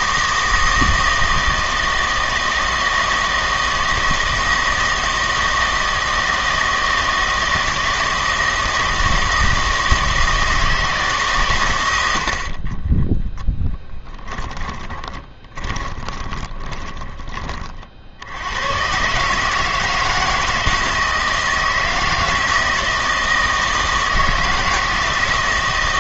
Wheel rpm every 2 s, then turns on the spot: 160, 160, 160, 160, 160, 160, 30, 20, 20, 110, 160, 160, 160.
14-18